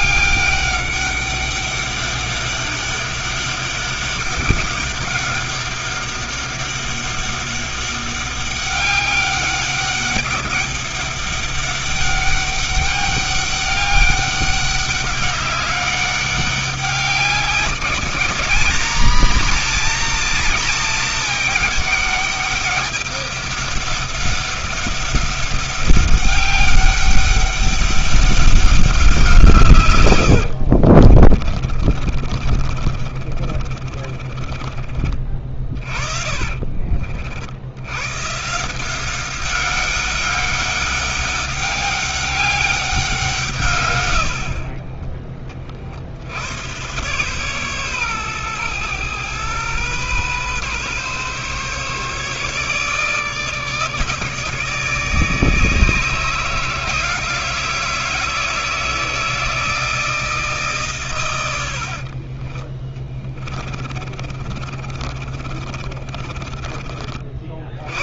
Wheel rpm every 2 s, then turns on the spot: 200, 200, 200, 200, 200, 200, 200, 200, 200, 230, 220, 200, 200, 200, 190, 50, 50, 40, 50, 180, 200, 190, 50, 120, 120, 130, 150, 160, 160, 160, 130, 30, 40, 50.
30-36 44-46 62-66